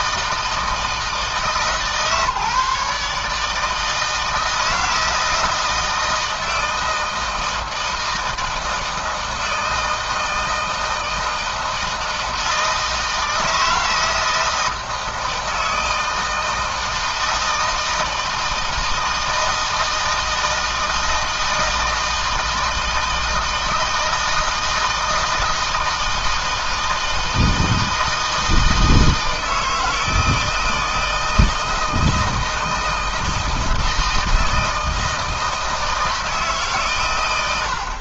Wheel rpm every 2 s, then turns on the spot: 160, 150, 160, 160, 160, 160, 160, 160, 160, 160, 160, 160, 160, 160, 160, 160, 160, 160, 130.
none